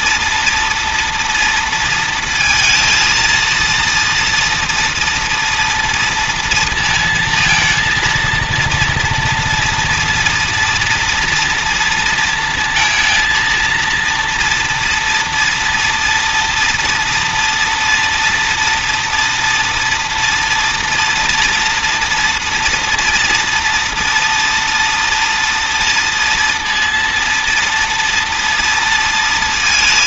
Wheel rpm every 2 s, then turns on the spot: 230, 220, 230, 230, 230, 230, 230, 230, 230, 230, 230, 230, 230, 230, 230.
none